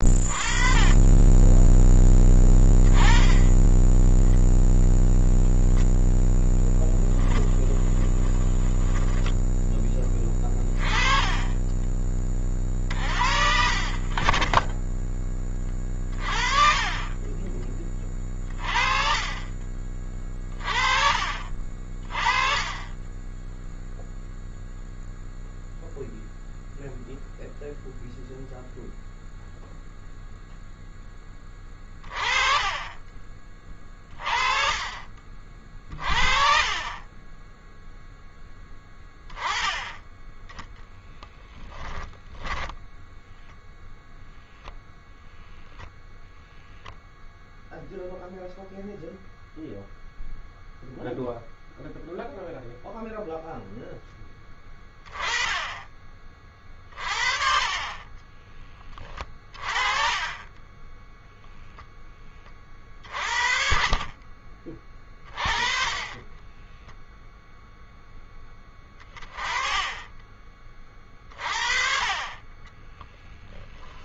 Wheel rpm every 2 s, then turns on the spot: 20, 20, 0, 10, 10, 20, 50, 20, 30, 30, 40, 20, 0, 0, 0, 10, 30, 40, 20, 10, 10, 10, 0, 0, 0, 0, 0, 20, 30, 30, 10, 40, 20, 0, 20, 30, 10.
6-8 16-18 32-34 40-44 68-70 72-74